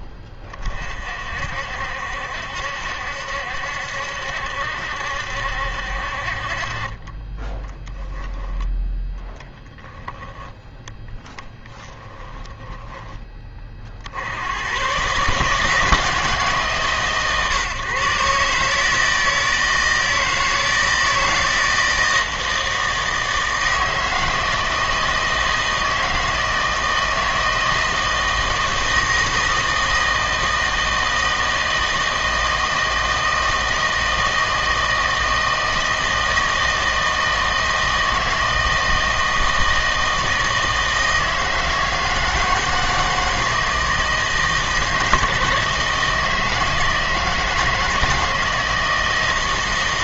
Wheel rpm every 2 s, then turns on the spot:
30, 70, 70, 40, 10, 10, 10, 90, 150, 150, 160, 160, 160, 160, 160, 160, 160, 160, 160, 160, 160, 160, 160, 160, 160.
12-14